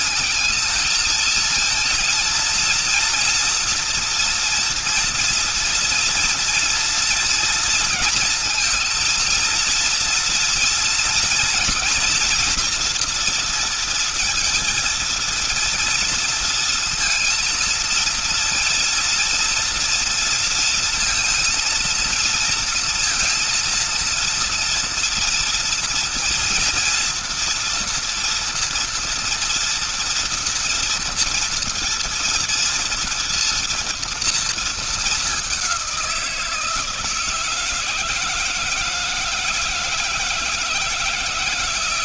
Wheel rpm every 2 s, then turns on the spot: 220, 230, 240, 230, 230, 230, 240, 230, 230, 230, 230, 230, 230, 230, 240, 230, 230, 230, 170, 160, 160.
none